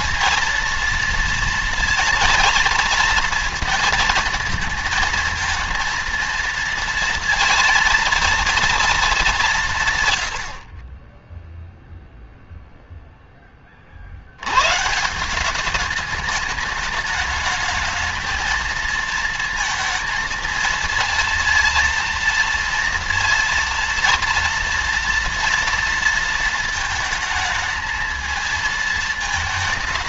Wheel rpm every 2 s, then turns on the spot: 220, 230, 220, 230, 230, 100, 0, 110, 210, 220, 230, 230, 230, 230, 220.
none